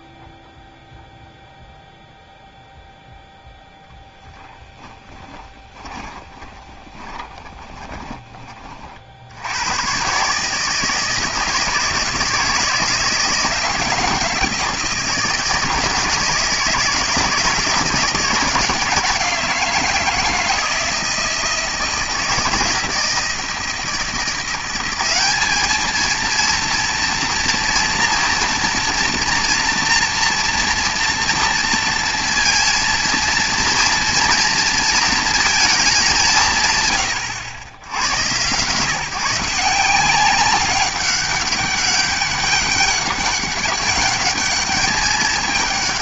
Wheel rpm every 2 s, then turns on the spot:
0, 0, 0, 20, 30, 150, 160, 170, 160, 160, 160, 160, 180, 230, 230, 230, 230, 230, 150, 140, 190, 200, 210.
6-8